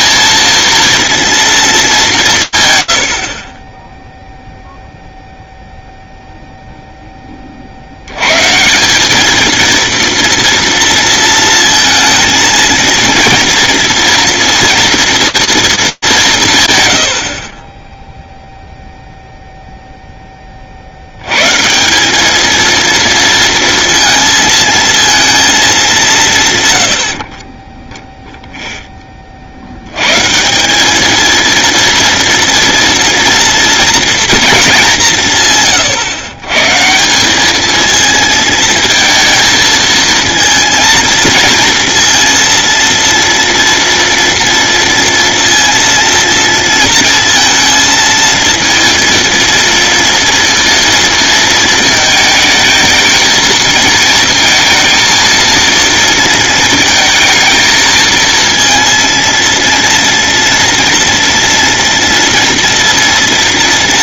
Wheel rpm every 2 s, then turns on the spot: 230, 120, 0, 0, 180, 230, 230, 230, 80, 0, 60, 230, 230, 100, 0, 200, 230, 190, 150, 230, 230, 230, 230, 230, 230, 230, 220, 230, 220, 230, 230, 230.
none